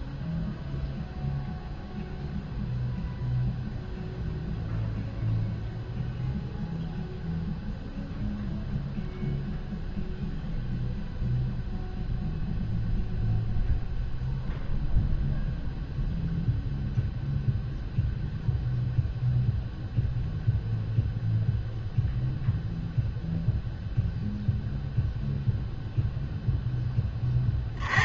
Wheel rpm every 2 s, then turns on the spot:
0, 0, 0, 0, 0, 0, 0, 0, 0, 0, 0, 0, 0, 0.
none